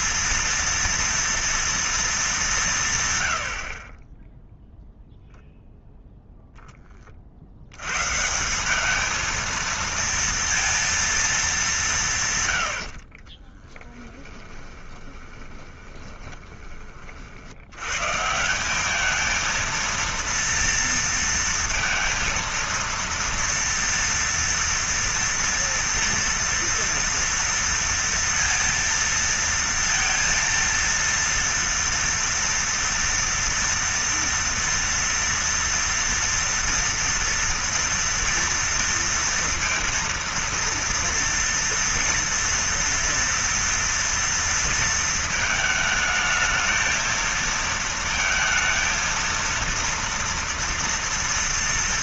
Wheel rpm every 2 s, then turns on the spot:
230, 170, 0, 10, 200, 230, 70, 20, 30, 190, 230, 230, 230, 230, 230, 230, 240, 230, 230, 230, 230, 230, 230, 220, 230, 230.
12-16